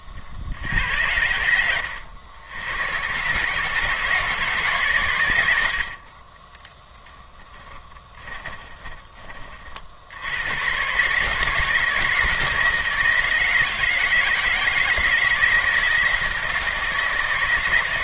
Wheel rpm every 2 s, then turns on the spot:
90, 110, 120, 10, 20, 130, 160, 160, 160.
6-8